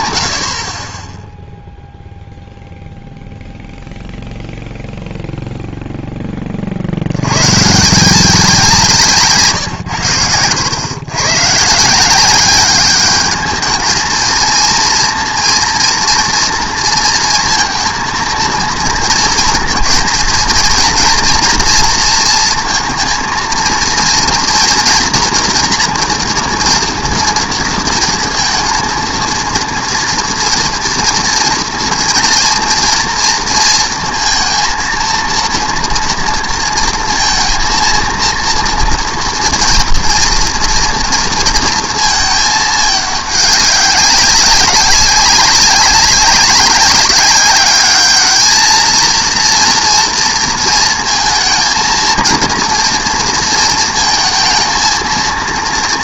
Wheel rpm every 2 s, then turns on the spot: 0, 0, 20, 170, 90, 190, 230, 230, 230, 230, 230, 230, 230, 230, 230, 230, 230, 230, 230, 230, 220, 200, 200, 210, 230, 230, 230, 230.
none